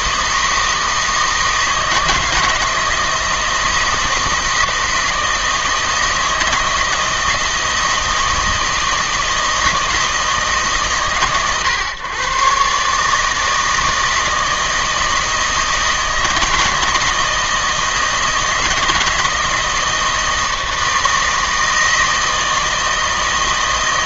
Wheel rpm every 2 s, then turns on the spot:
160, 160, 160, 160, 160, 150, 140, 160, 160, 160, 160, 160.
none